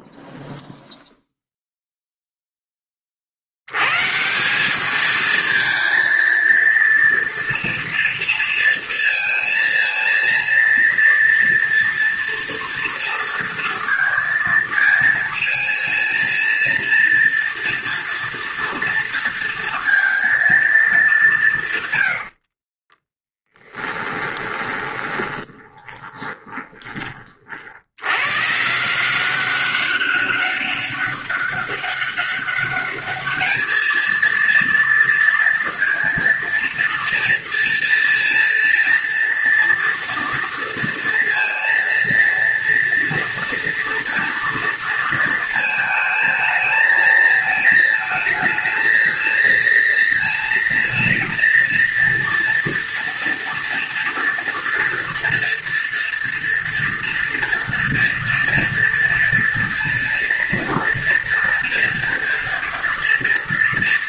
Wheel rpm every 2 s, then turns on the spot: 0, 20, 200, 230, 230, 230, 230, 230, 230, 230, 220, 30, 20, 20, 160, 200, 200, 230, 230, 230, 230, 230, 230, 220, 220, 230, 230, 230, 230, 230, 230, 230.
22-26